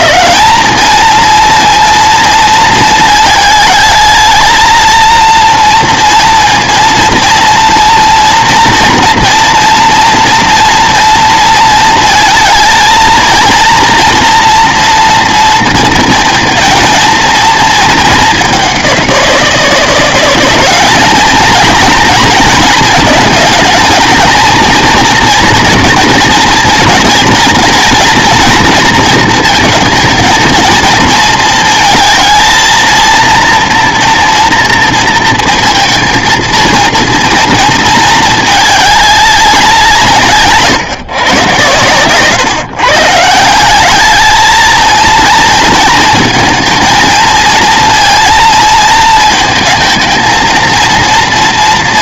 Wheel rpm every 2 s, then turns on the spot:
210, 220, 220, 230, 230, 230, 220, 230, 230, 200, 200, 230, 230, 230, 230, 230, 230, 230, 230, 210, 150, 140, 220, 230, 230, 230.
none